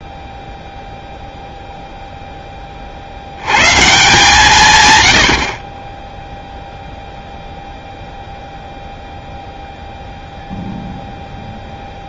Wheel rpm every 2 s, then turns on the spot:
0, 40, 140, 0, 0, 0.
none